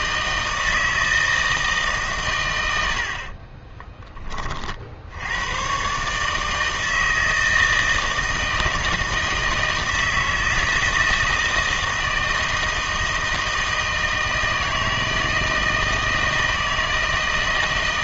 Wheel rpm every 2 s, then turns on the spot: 160, 110, 40, 160, 160, 160, 160, 160, 160.
none